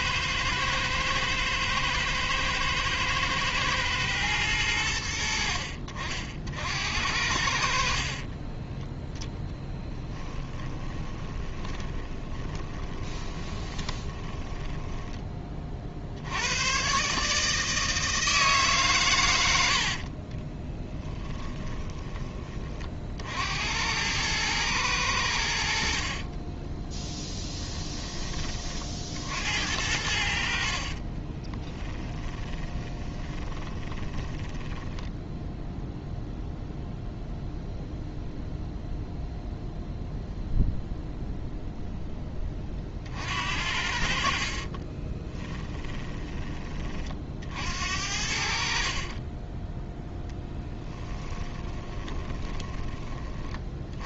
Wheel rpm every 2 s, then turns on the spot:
110, 110, 90, 80, 10, 20, 20, 10, 130, 140, 10, 40, 100, 10, 50, 40, 20, 10, 0, 0, 0, 40, 30, 40, 40, 10, 20.
8-14 20-22 30-36 44-46 48-54